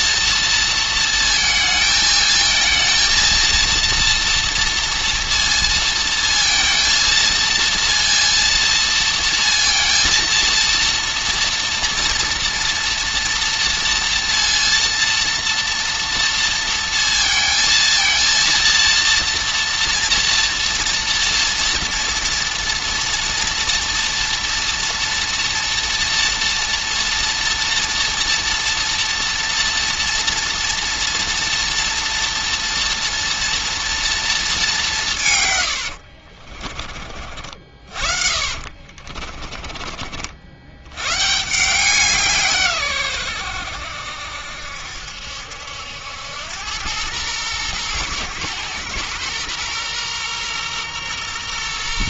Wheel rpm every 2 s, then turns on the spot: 230, 230, 230, 230, 230, 230, 230, 230, 230, 230, 230, 240, 240, 230, 240, 230, 230, 180, 40, 40, 110, 120, 70, 110, 120, 120.
38-40